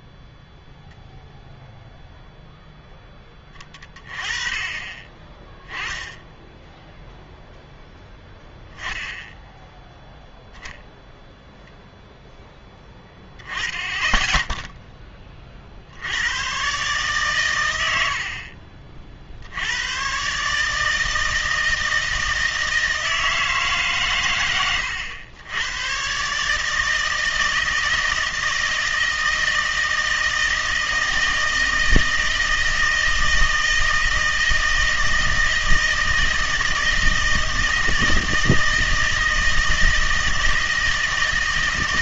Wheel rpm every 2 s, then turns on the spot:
0, 0, 30, 0, 0, 0, 10, 10, 120, 40, 150, 160, 100, 150, 160, 160, 160, 160, 160, 160, 160.
none